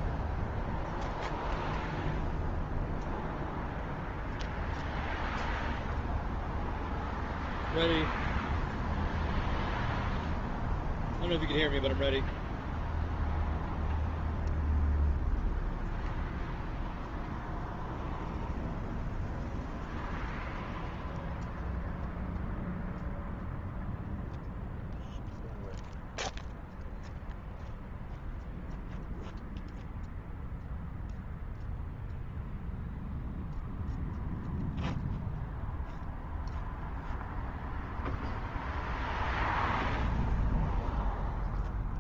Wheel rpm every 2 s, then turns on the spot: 0, 0, 0, 0, 0, 0, 0, 0, 0, 0, 0, 0, 0, 0, 0, 0, 0, 0, 0, 0, 0.
none